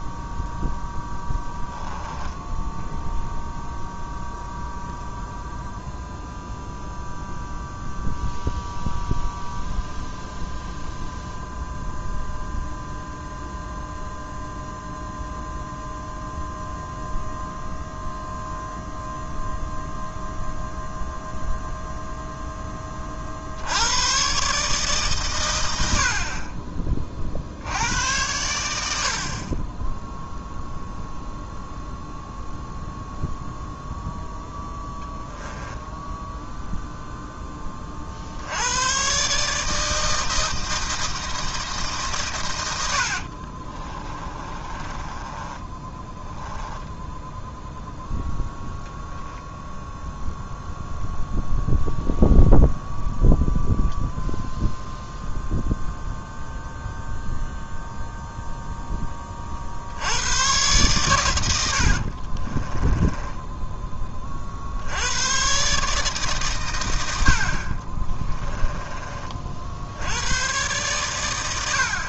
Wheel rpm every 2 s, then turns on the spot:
0, 0, 0, 0, 0, 0, 0, 0, 0, 0, 0, 30, 140, 30, 70, 0, 0, 10, 0, 120, 160, 90, 20, 0, 0, 0, 0, 0, 0, 10, 110, 10, 90, 90, 20, 120.
42-46 62-64